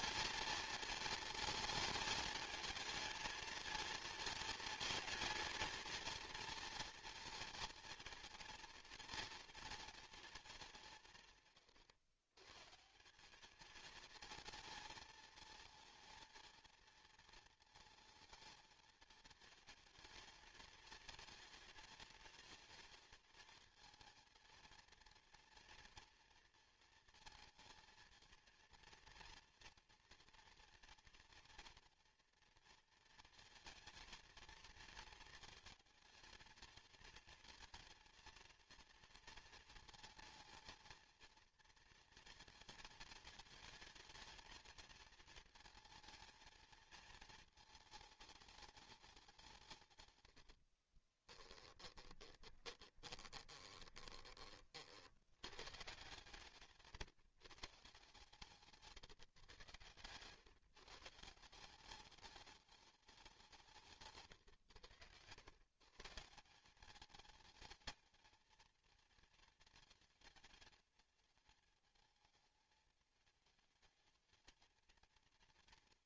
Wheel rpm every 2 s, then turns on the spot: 230, 220, 230, 240, 230, 190, 150, 220, 230, 220, 220, 220, 230, 230, 230, 230, 230, 230, 220, 230, 230, 220, 220, 230, 220, 60, 20, 40, 140, 150, 140, 200, 100, 190, 230, 220, 220, 220.
50-54 56-58